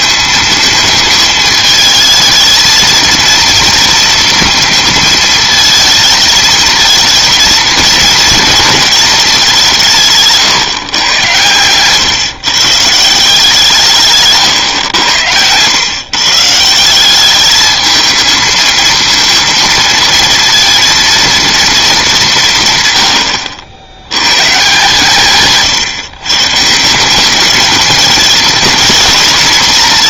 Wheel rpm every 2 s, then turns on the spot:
220, 220, 230, 220, 230, 130, 150, 120, 160, 230, 230, 130, 150, 160, 220.
none